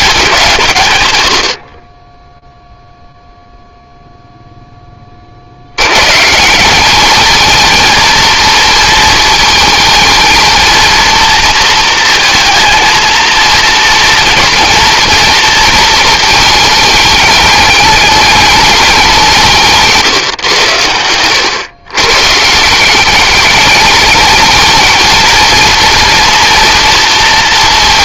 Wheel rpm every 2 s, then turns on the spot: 130, 0, 20, 200, 230, 230, 230, 230, 210, 200, 100, 180, 220, 230.
20-22